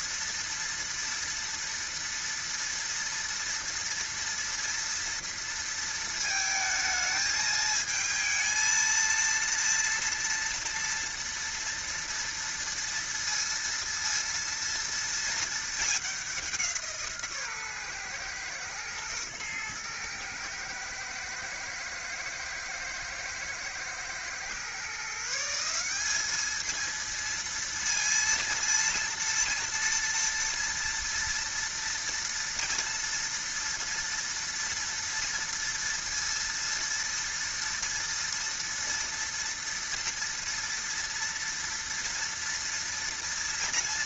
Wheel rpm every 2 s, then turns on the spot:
230, 230, 230, 220, 230, 230, 230, 230, 160, 110, 110, 110, 140, 230, 230, 230, 230, 230, 230, 240, 230, 230.
none